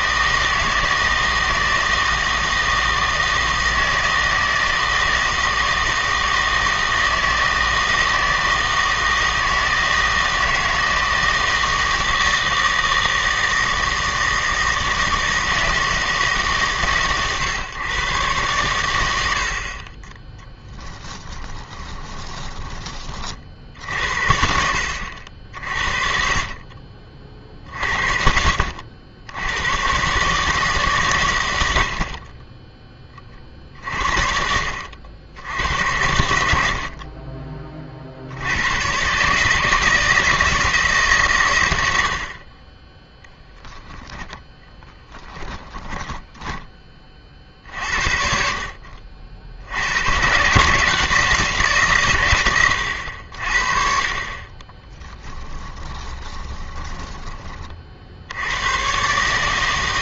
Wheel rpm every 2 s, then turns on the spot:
160, 160, 160, 160, 160, 160, 160, 160, 140, 110, 10, 20, 60, 40, 50, 140, 20, 60, 70, 110, 160, 30, 10, 10, 50, 140, 100, 30, 20, 100.
22-24 46-48 54-58